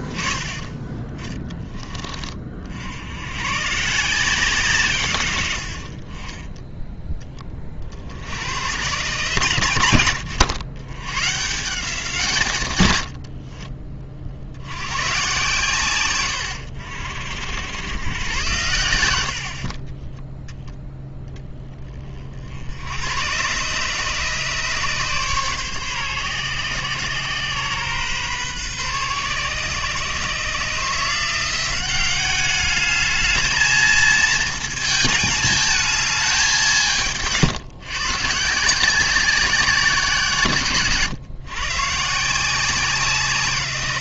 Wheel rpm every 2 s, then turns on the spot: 30, 50, 150, 10, 100, 90, 140, 80, 90, 100, 0, 60, 150, 130, 130, 150, 200, 220, 190, 160, 140, 180.
18-20